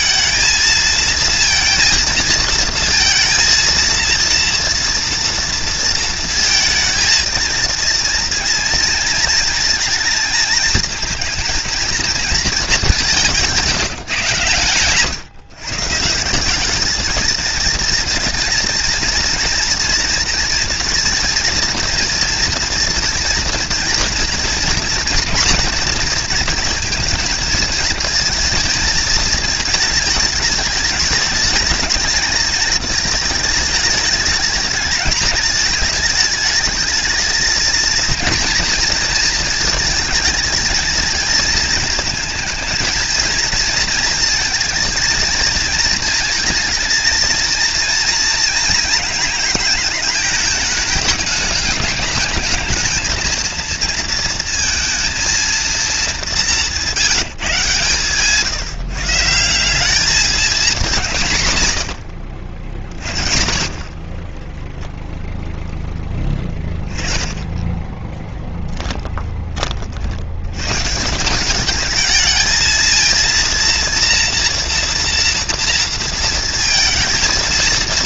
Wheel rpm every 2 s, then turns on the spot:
220, 230, 230, 230, 230, 230, 200, 130, 220, 220, 230, 230, 230, 230, 220, 220, 220, 220, 220, 220, 220, 230, 230, 230, 230, 210, 220, 230, 180, 150, 190, 40, 0, 20, 10, 150, 220, 240, 230.
68-70